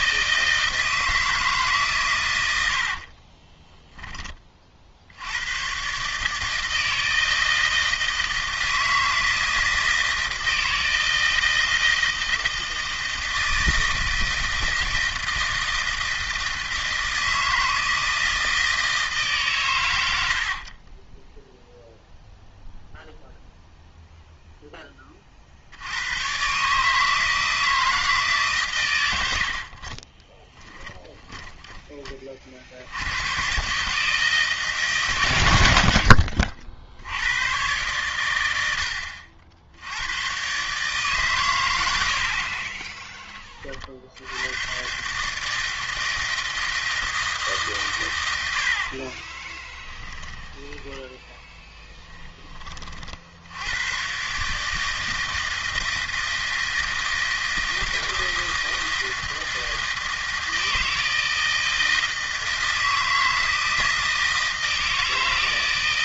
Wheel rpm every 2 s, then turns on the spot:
160, 70, 40, 160, 160, 160, 160, 160, 160, 160, 30, 0, 10, 140, 130, 20, 50, 150, 50, 80, 140, 30, 120, 160, 70, 10, 30, 150, 160, 160, 160, 160, 160.
30-32 42-44